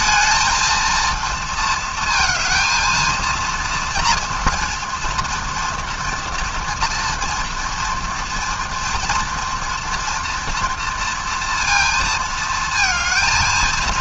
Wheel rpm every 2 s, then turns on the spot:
230, 220, 230, 230, 230, 230, 230.
none